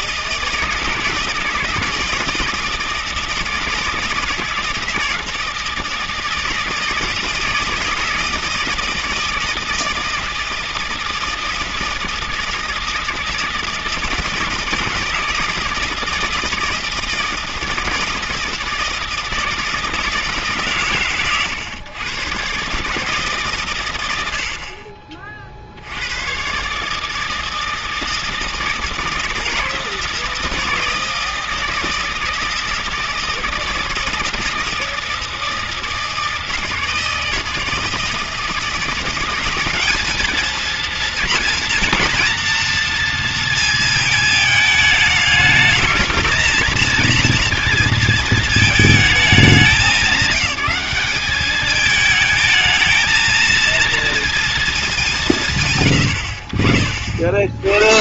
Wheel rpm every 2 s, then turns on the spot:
160, 160, 160, 160, 160, 160, 160, 160, 160, 160, 140, 140, 50, 140, 160, 160, 160, 160, 160, 170, 230, 230, 220, 230, 220, 200, 220, 220, 60.
none